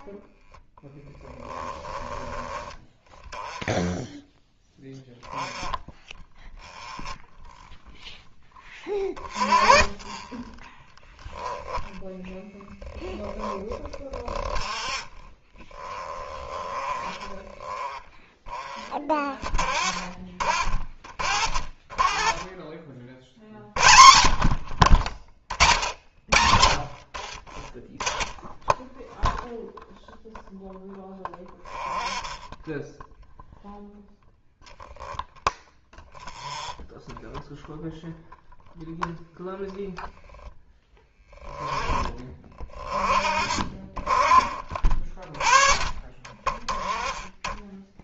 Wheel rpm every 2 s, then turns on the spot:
10, 20, 10, 0, 10, 20, 0, 0, 20, 20, 40, 30, 40, 80, 0, 0, 10, 0, 10, 0, 10, 30, 30, 30.
0-2